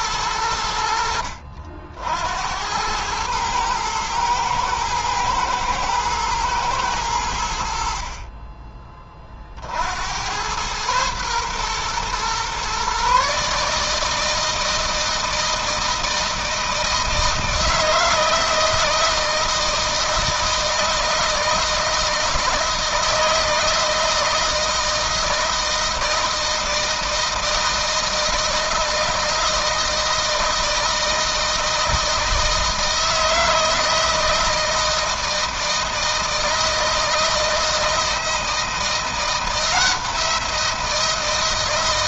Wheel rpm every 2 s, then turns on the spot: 80, 100, 110, 100, 30, 110, 130, 160, 160, 160, 160, 160, 160, 160, 160, 160, 160, 160, 160, 170, 170.
none